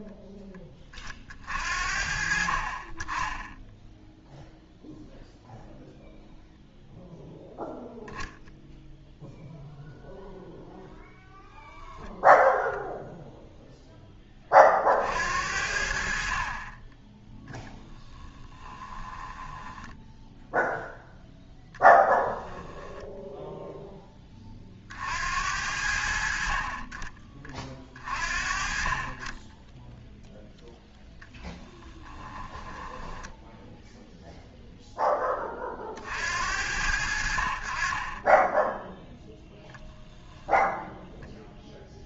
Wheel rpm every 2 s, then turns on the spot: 20, 40, 0, 0, 0, 0, 0, 40, 30, 30, 0, 10, 40, 40, 40, 0, 10, 0, 80, 10, 10.
18-20 22-24 32-34